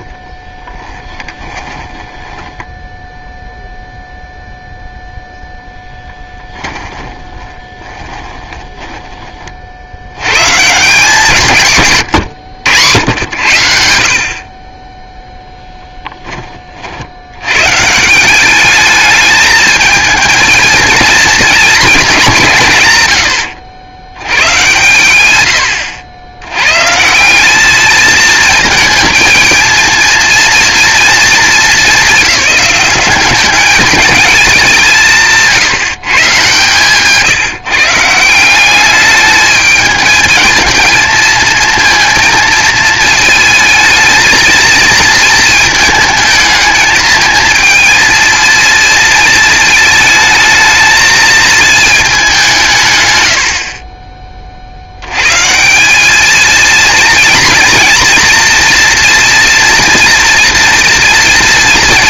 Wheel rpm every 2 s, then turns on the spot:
20, 10, 0, 10, 10, 150, 100, 30, 50, 210, 220, 130, 110, 140, 230, 230, 190, 170, 130, 200, 220, 220, 220, 220, 230, 220, 140, 80, 220, 230, 230.
0-4 6-10 36-38